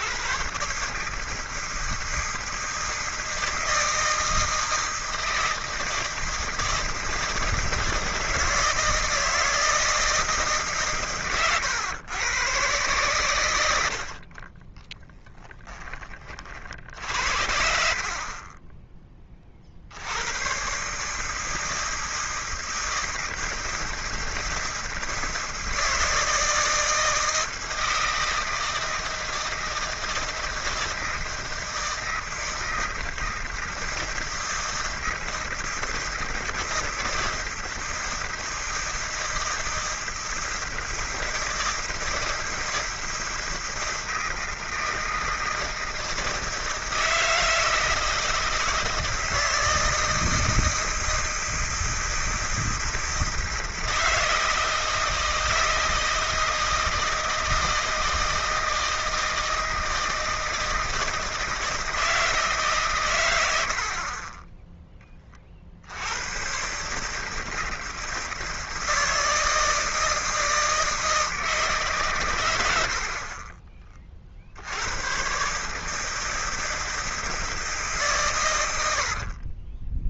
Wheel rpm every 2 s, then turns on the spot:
130, 160, 160, 160, 160, 150, 120, 20, 50, 20, 120, 160, 160, 160, 160, 160, 160, 160, 160, 160, 160, 160, 160, 160, 160, 160, 160, 160, 160, 160, 160, 140, 10, 140, 160, 160, 80, 80, 160, 90.
none